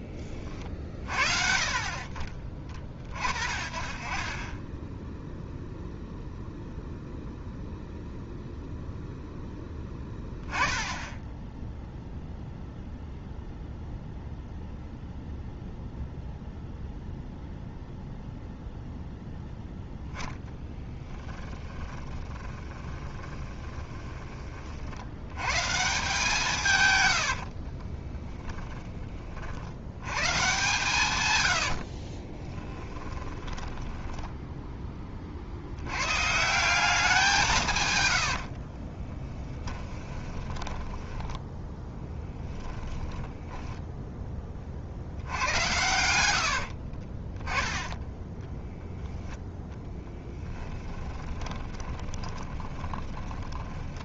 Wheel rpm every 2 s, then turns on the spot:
40, 20, 0, 0, 0, 10, 0, 0, 0, 0, 10, 20, 50, 130, 10, 130, 20, 10, 170, 40, 10, 10, 40, 70, 10, 10, 20.
20-24 32-34 38-44 46-48 50-54